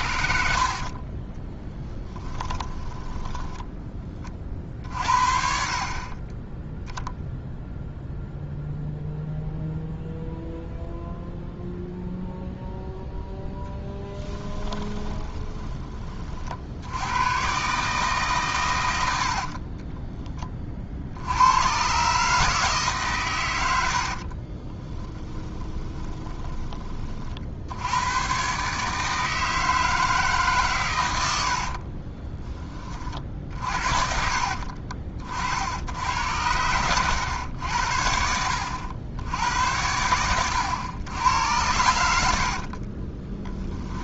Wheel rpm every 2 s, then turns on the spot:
40, 10, 60, 0, 0, 0, 0, 20, 90, 90, 60, 140, 30, 30, 150, 120, 30, 40, 100, 80, 100, 30.
0-4 14-16 18-20 24-26 42-44